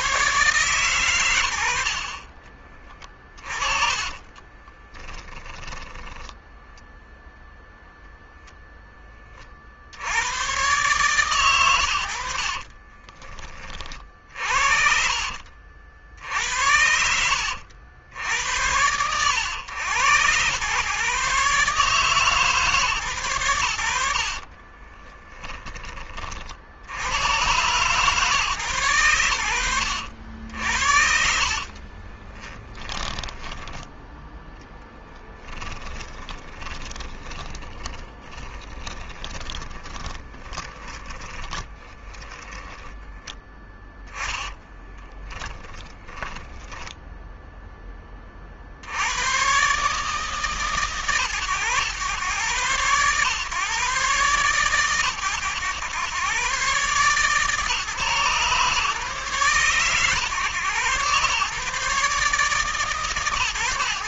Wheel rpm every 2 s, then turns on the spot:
120, 20, 10, 0, 10, 130, 30, 50, 70, 90, 120, 130, 20, 80, 120, 70, 10, 10, 20, 30, 20, 10, 10, 10, 60, 150, 130, 120, 140, 140, 130, 150.
2-6 12-14 24-26 30-46